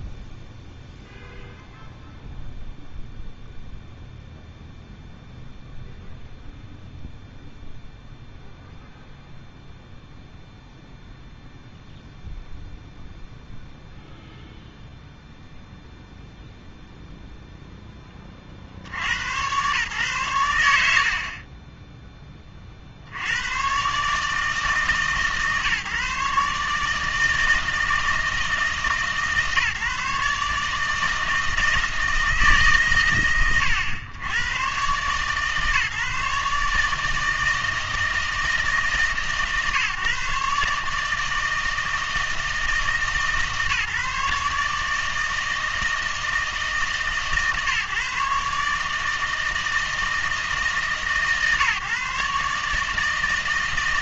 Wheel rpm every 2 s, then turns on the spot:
0, 0, 0, 0, 0, 0, 0, 0, 0, 60, 90, 30, 150, 150, 160, 150, 140, 120, 150, 150, 150, 160, 150, 160, 150, 160, 150.
none